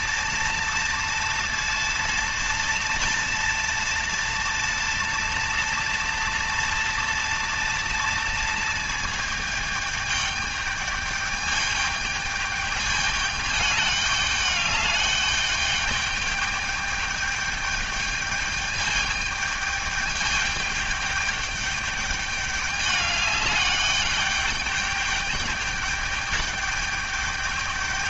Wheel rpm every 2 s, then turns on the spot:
230, 230, 230, 230, 230, 210, 210, 210, 210, 210, 210, 210, 210, 210.
none